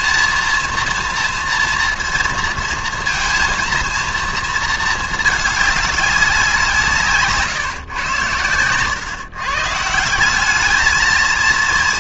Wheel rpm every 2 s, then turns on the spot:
230, 230, 230, 180, 120, 210.
none